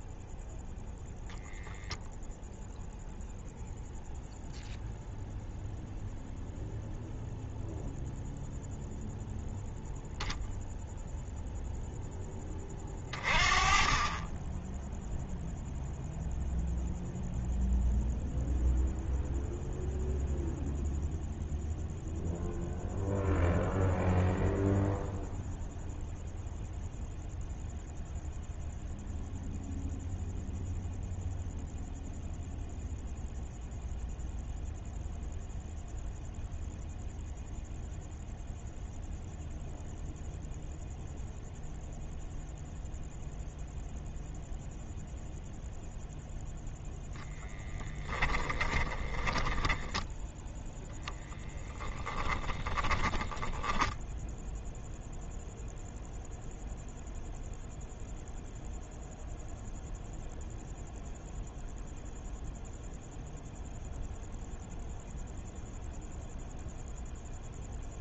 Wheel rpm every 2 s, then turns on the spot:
0, 0, 0, 0, 0, 0, 20, 0, 0, 0, 0, 0, 0, 0, 0, 0, 0, 0, 0, 0, 0, 0, 0, 0, 10, 0, 20, 0, 0, 0, 0, 0, 0, 0.
48-50 52-54